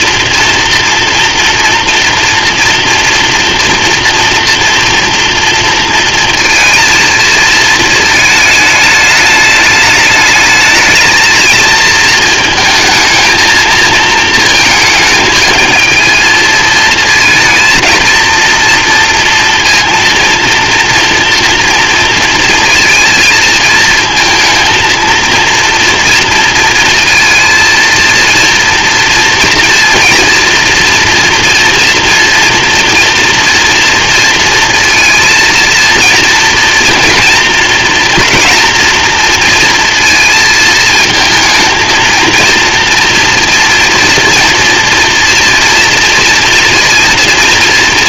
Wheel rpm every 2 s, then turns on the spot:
230, 230, 230, 230, 210, 220, 230, 220, 230, 230, 240, 230, 230, 230, 230, 230, 240, 230, 230, 230, 220, 230, 230, 230.
none